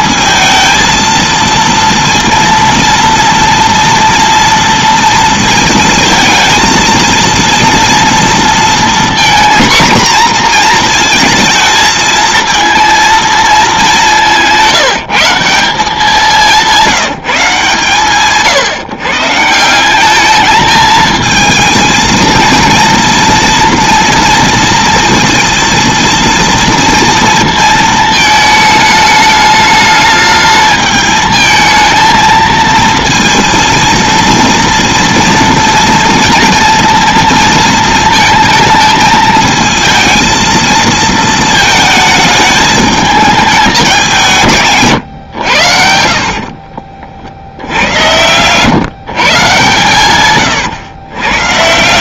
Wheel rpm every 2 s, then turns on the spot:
230, 230, 230, 230, 230, 240, 230, 170, 180, 150, 210, 230, 230, 230, 220, 210, 230, 230, 230, 230, 230, 220, 160, 50, 120, 120.
46-48 50-52